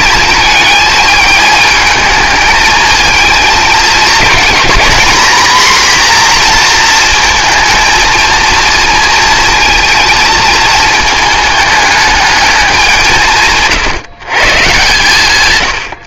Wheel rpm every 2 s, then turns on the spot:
220, 220, 220, 240, 230, 220, 200, 140.
none